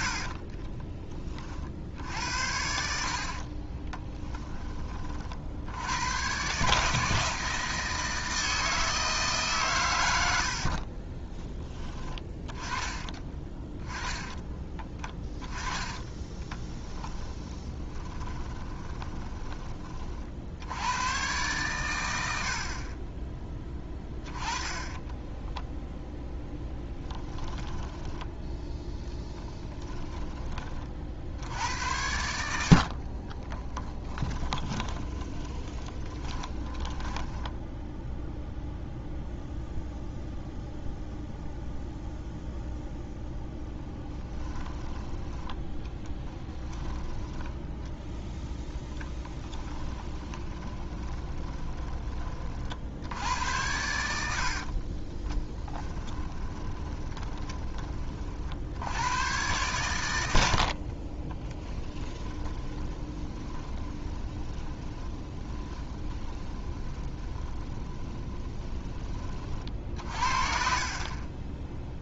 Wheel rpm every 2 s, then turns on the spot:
20, 60, 30, 150, 160, 40, 20, 20, 10, 20, 90, 50, 20, 10, 10, 40, 60, 20, 10, 0, 0, 0, 10, 10, 10, 20, 60, 40, 20, 90, 50, 20, 20, 20, 20, 40.
10-12 14-20 24-28 32-38 46-52 54-58 60-68